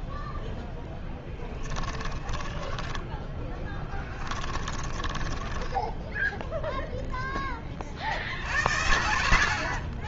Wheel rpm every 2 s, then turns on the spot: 0, 10, 20, 0, 80.
2-6